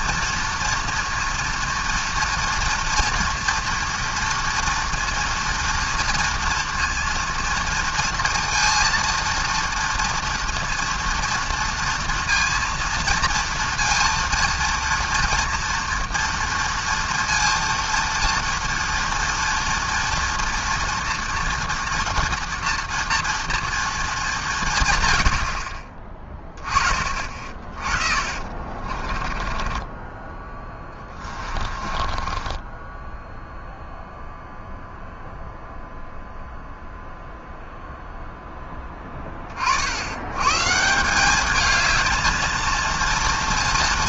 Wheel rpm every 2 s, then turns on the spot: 230, 240, 230, 240, 230, 230, 230, 230, 230, 230, 230, 230, 130, 20, 40, 20, 20, 0, 0, 10, 150, 230.
28-34